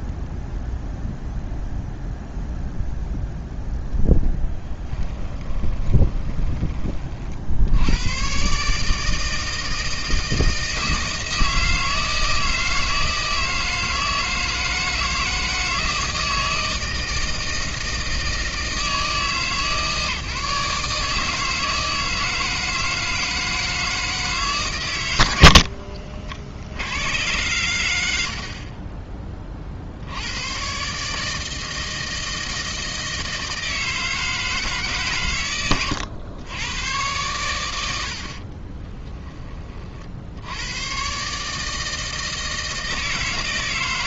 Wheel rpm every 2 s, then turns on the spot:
0, 0, 10, 30, 150, 160, 160, 160, 160, 160, 150, 160, 120, 80, 50, 120, 160, 150, 110, 20, 120, 160.
4-6 38-40